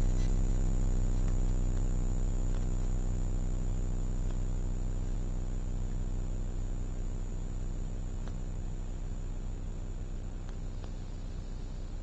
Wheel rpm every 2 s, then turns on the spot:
0, 0, 0, 0, 0, 0.
none